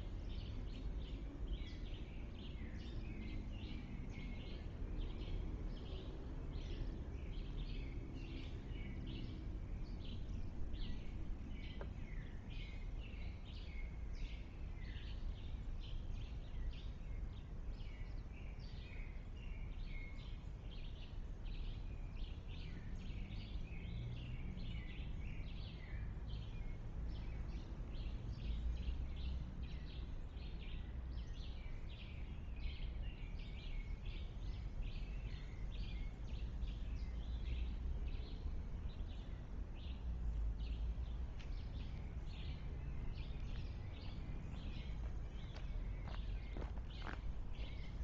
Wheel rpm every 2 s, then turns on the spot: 0, 0, 0, 0, 0, 0, 0, 0, 0, 0, 0, 0, 0, 0, 0, 0, 0, 0, 0, 0, 0, 0, 0, 0.
none